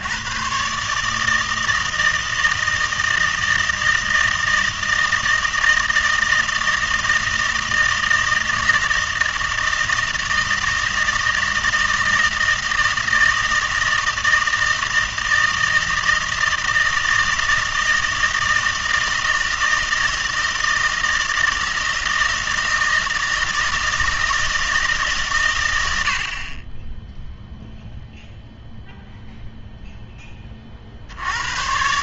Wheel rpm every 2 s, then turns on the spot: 130, 160, 160, 160, 160, 160, 160, 160, 160, 160, 160, 160, 160, 30, 0, 30.
none